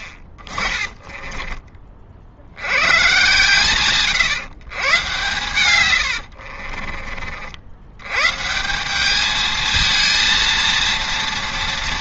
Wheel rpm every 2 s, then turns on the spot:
30, 90, 120, 50, 160, 230.
6-8